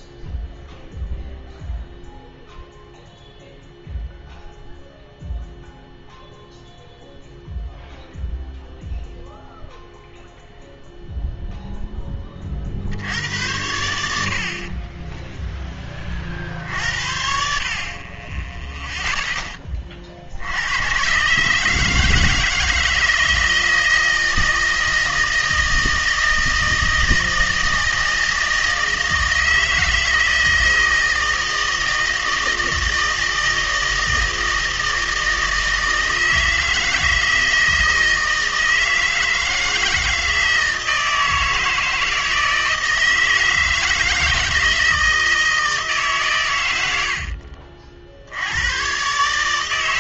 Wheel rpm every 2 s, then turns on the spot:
0, 0, 0, 0, 0, 0, 70, 10, 60, 0, 110, 160, 160, 160, 160, 160, 160, 160, 160, 160, 160, 160, 160, 90, 110.
14-16